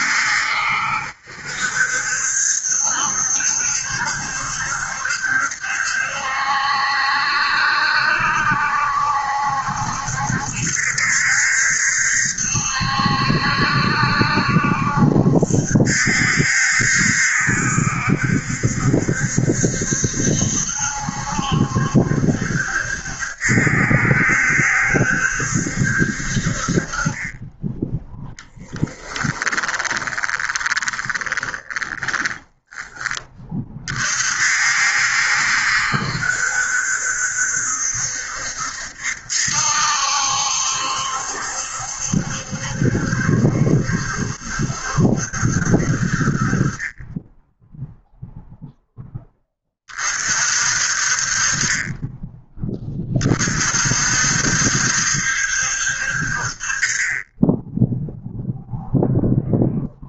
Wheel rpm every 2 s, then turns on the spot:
70, 70, 70, 70, 70, 70, 70, 70, 70, 70, 70, 70, 70, 30, 10, 20, 10, 60, 70, 70, 70, 70, 70, 20, 10, 40, 30, 70, 30, 0.
28-32